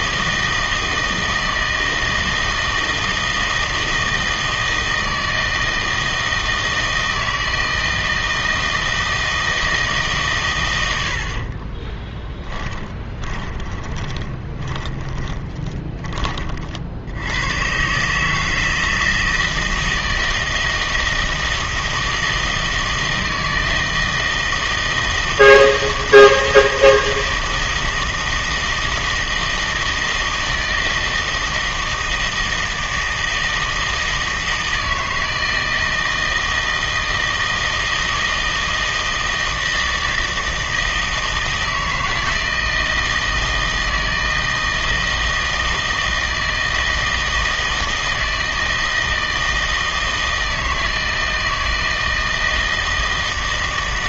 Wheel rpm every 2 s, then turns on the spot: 160, 160, 160, 160, 160, 100, 10, 20, 50, 160, 160, 160, 160, 160, 160, 160, 160, 160, 160, 160, 160, 160, 160, 160, 160, 160, 160.
12-16